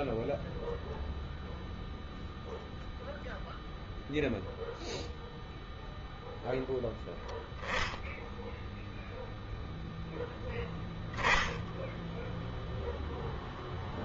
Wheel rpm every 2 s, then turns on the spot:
0, 0, 0, 0, 0, 10, 20.
none